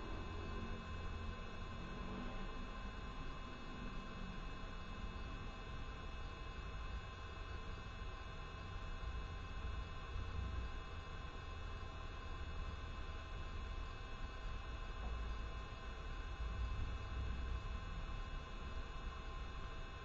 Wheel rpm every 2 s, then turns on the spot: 0, 0, 0, 0, 0, 0, 0, 0, 0, 0.
none